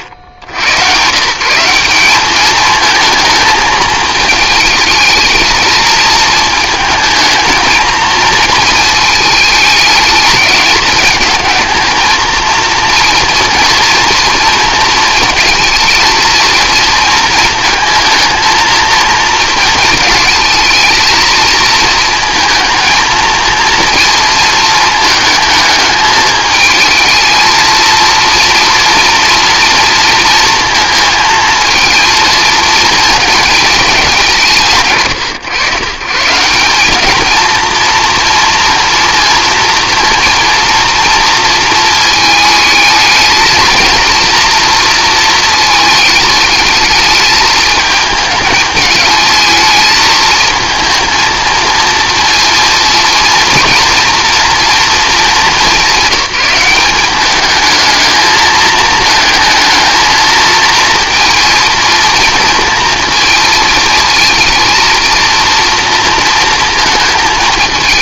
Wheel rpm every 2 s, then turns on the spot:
90, 220, 220, 220, 230, 210, 230, 230, 230, 230, 220, 230, 220, 220, 230, 230, 230, 160, 190, 230, 230, 220, 230, 210, 210, 230, 230, 240, 190, 220, 220, 230, 230, 230.
none